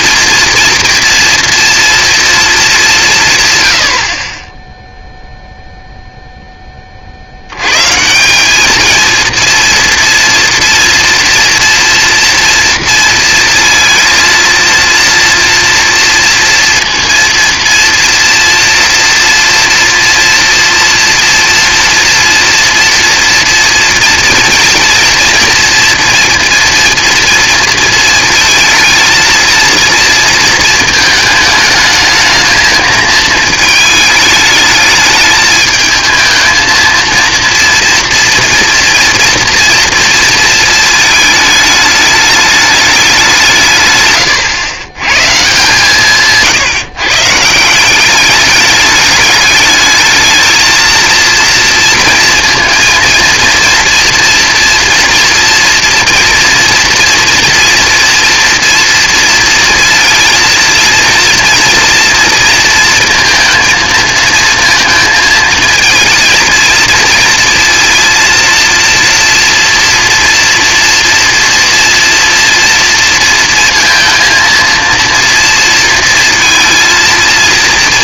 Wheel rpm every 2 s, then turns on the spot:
230, 240, 80, 0, 160, 230, 230, 230, 230, 230, 240, 240, 230, 230, 230, 230, 220, 220, 220, 230, 230, 210, 130, 150, 190, 220, 230, 230, 230, 230, 230, 230, 230, 230, 230, 240, 230, 230, 230.
none